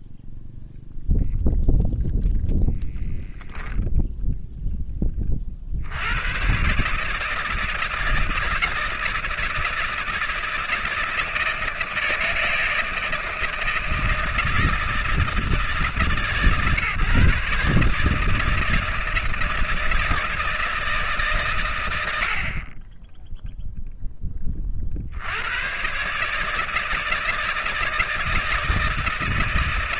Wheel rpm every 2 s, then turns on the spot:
0, 0, 30, 150, 160, 160, 160, 160, 140, 160, 140, 10, 40, 160, 160.
none